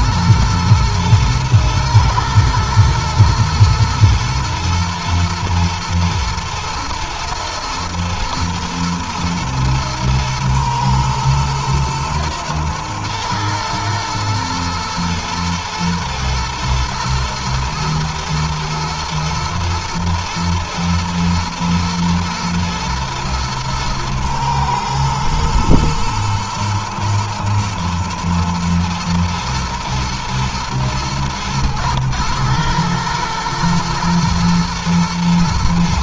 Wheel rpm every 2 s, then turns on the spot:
120, 120, 110, 110, 120, 110, 110, 120, 110, 110, 110, 120, 120, 110, 110, 120, 110, 110.
none